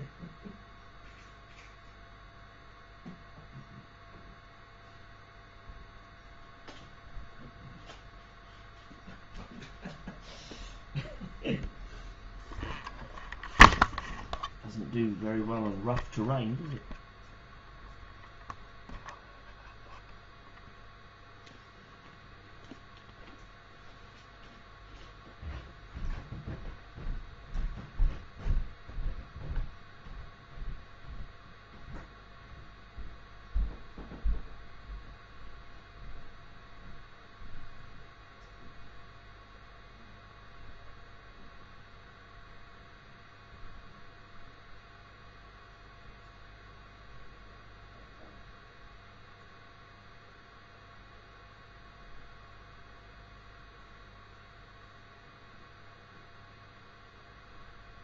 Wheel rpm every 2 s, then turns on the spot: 0, 0, 0, 0, 0, 0, 0, 0, 0, 0, 0, 0, 0, 0, 0, 0, 0, 0, 0, 0, 0, 0, 0, 0, 0, 0, 0, 0, 0.
none